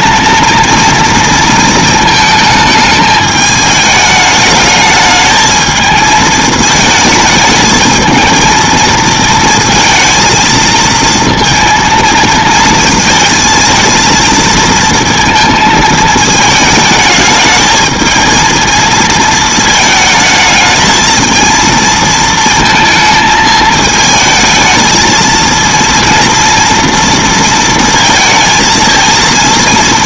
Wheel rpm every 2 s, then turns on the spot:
230, 220, 210, 220, 230, 230, 220, 230, 220, 230, 220, 230, 220, 230, 220.
none